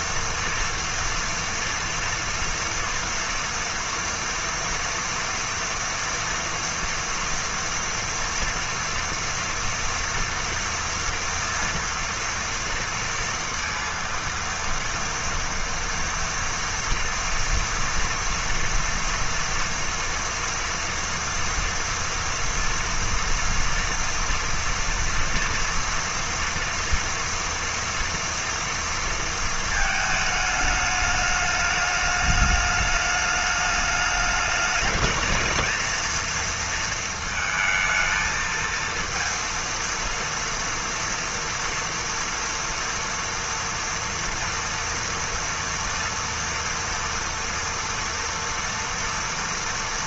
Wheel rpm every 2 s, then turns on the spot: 230, 230, 230, 230, 230, 230, 230, 230, 230, 230, 230, 230, 230, 230, 230, 210, 210, 220, 220, 230, 230, 230, 230, 230, 230.
none